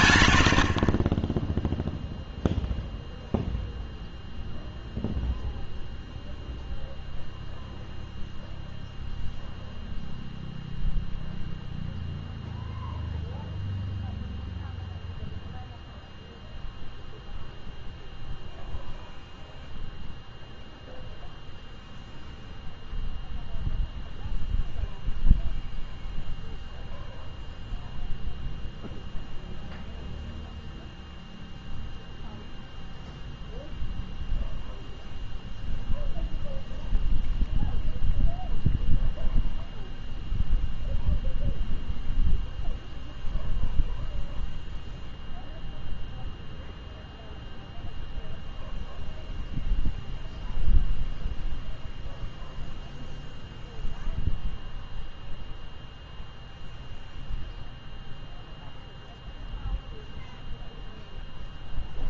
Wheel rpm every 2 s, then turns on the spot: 80, 0, 0, 0, 0, 0, 0, 0, 0, 0, 0, 0, 0, 0, 0, 0, 0, 0, 0, 0, 0, 0, 0, 0, 0, 0, 0, 0, 0, 0, 0.
none